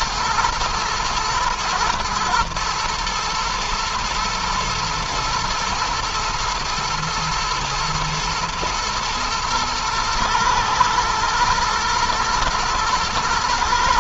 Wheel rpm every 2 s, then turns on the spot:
110, 120, 120, 110, 110, 110, 120.
none